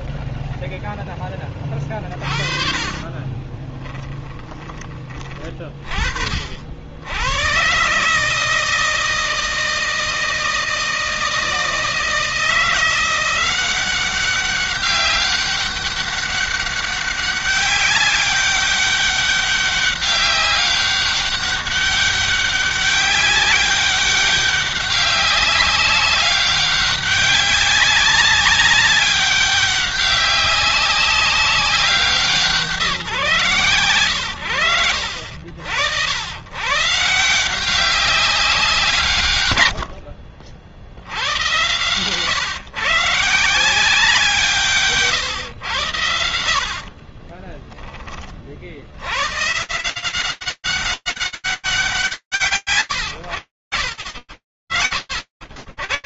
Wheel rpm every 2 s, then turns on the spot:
0, 30, 20, 30, 130, 160, 160, 190, 200, 200, 200, 200, 200, 200, 190, 200, 180, 100, 70, 190, 60, 120, 170, 110, 30, 170, 90, 70.
2-6